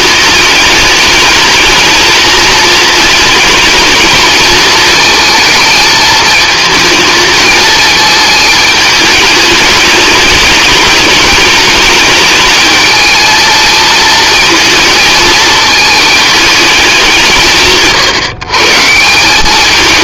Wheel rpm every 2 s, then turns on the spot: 210, 220, 220, 220, 220, 210, 220, 230, 160, 160.
none